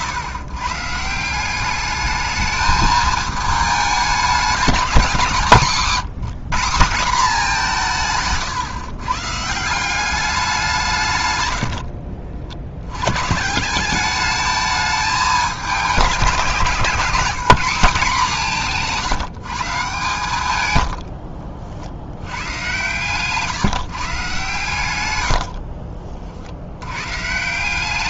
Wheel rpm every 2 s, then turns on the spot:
140, 220, 200, 190, 130, 170, 70, 210, 180, 170, 110, 110, 120, 90.
18-22